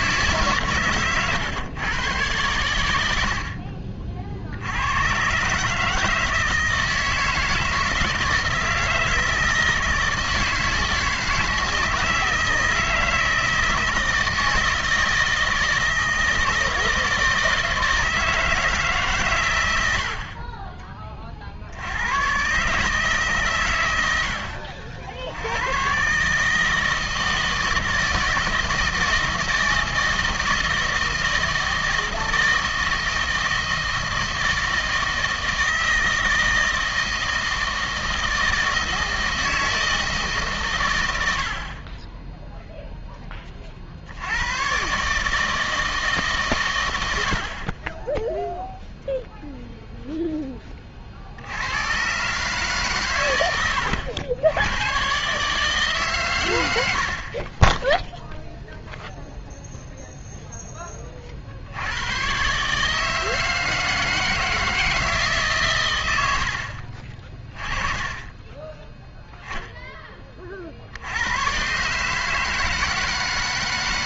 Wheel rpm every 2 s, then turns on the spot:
140, 110, 80, 160, 160, 160, 160, 160, 160, 160, 30, 130, 80, 160, 160, 160, 160, 160, 160, 160, 130, 0, 110, 130, 0, 20, 140, 100, 100, 0, 10, 140, 160, 60, 10, 40, 160.
none